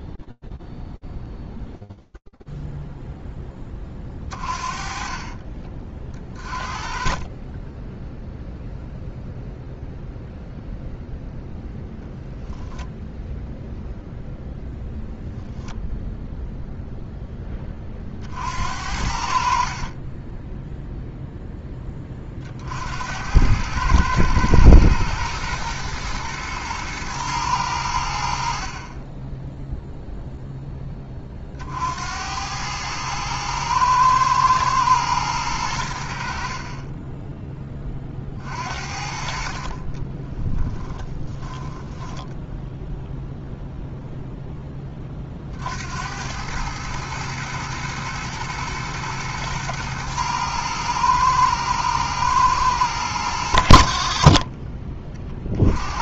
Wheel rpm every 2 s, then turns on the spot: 0, 0, 30, 40, 0, 0, 0, 0, 0, 60, 0, 80, 110, 110, 20, 40, 110, 90, 30, 30, 10, 10, 110, 110, 110, 110, 30, 60.
38-40